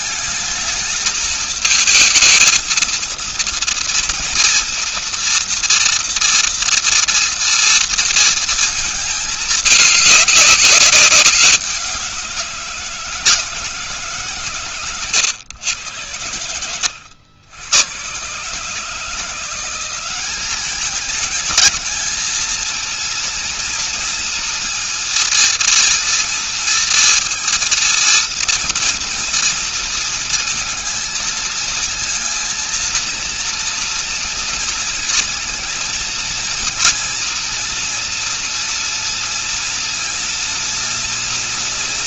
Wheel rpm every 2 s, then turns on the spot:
220, 230, 230, 230, 230, 200, 180, 140, 90, 140, 200, 220, 230, 230, 230, 230, 230, 230, 230, 230, 230.
none